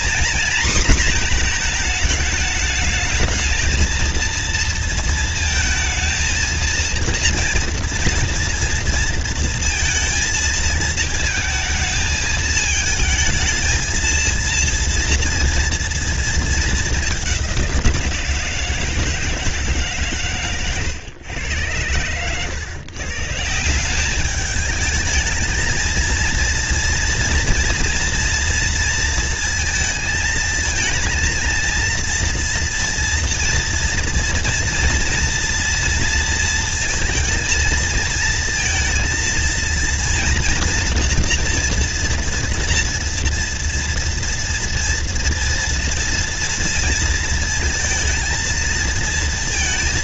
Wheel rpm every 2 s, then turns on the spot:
240, 220, 230, 230, 230, 220, 220, 230, 230, 170, 130, 100, 200, 230, 230, 220, 230, 230, 230, 230, 230, 230, 230, 230, 230.
none